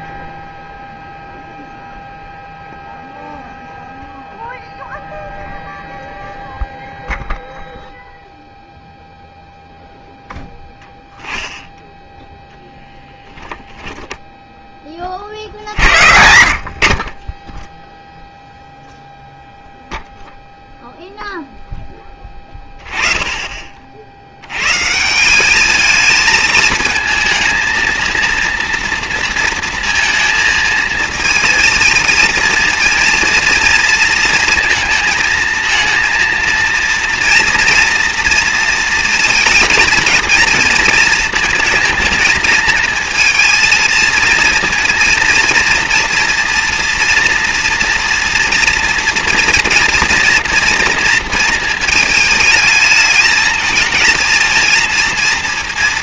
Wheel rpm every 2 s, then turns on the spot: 0, 0, 0, 0, 0, 10, 10, 60, 20, 0, 0, 30, 200, 220, 230, 230, 230, 230, 230, 230, 230, 230, 230, 240, 230, 220, 220, 230.
12-14